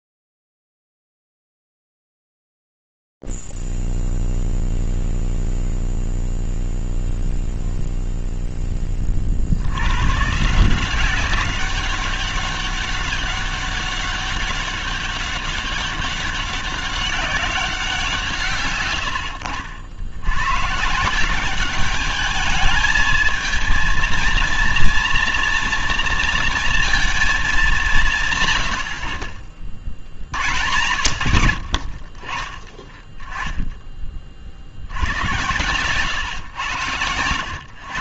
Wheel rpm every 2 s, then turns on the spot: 0, 0, 0, 0, 0, 110, 200, 200, 200, 160, 90, 210, 230, 230, 160, 100, 30, 50, 110.
none